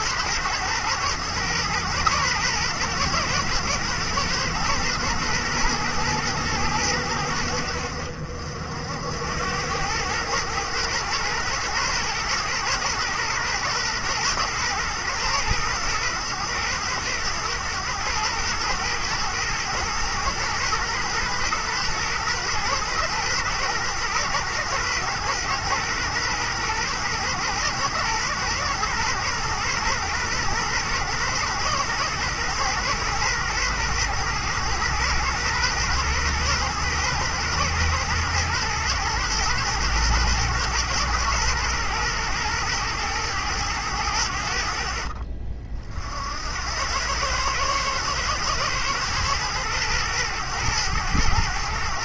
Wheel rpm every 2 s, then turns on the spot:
110, 110, 110, 110, 70, 110, 120, 120, 110, 110, 120, 120, 120, 120, 120, 120, 120, 110, 120, 120, 120, 110, 70, 80, 120, 110.
none